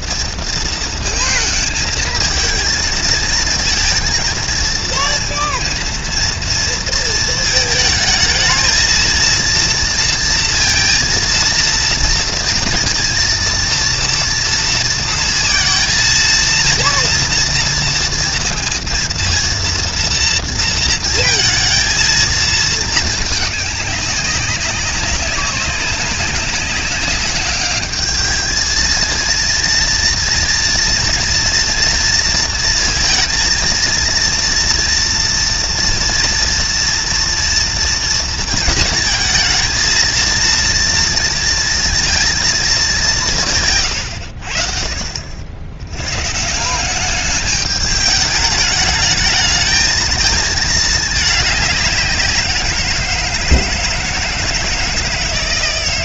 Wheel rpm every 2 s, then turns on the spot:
230, 220, 230, 230, 220, 230, 230, 230, 230, 230, 230, 220, 190, 200, 220, 240, 230, 230, 230, 220, 230, 210, 60, 190, 210, 210, 170, 160.
none